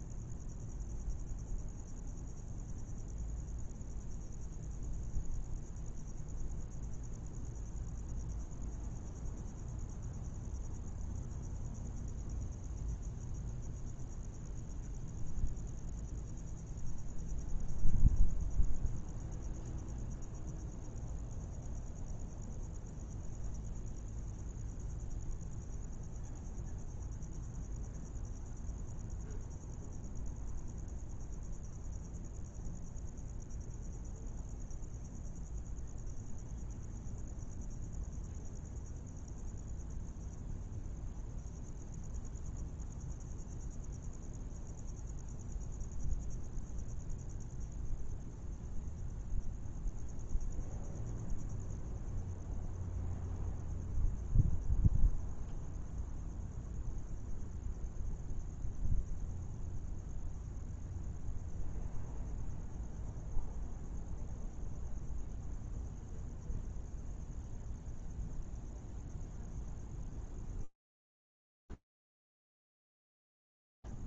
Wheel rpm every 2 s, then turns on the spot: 0, 0, 0, 0, 0, 0, 0, 0, 0, 0, 0, 0, 0, 0, 0, 0, 0, 0, 0, 0, 0, 0, 0, 0, 0, 0, 0, 0, 0, 0, 0, 0, 0, 0, 0, 0, 0.
none